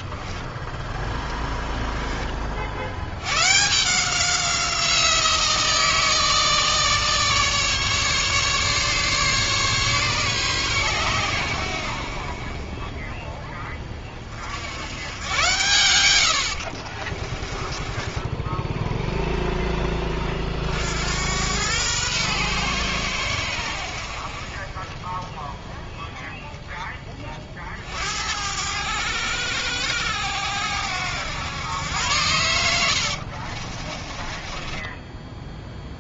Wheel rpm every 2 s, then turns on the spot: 0, 70, 180, 150, 150, 120, 30, 80, 50, 10, 60, 110, 30, 20, 90, 90, 90, 20.
16-20 32-36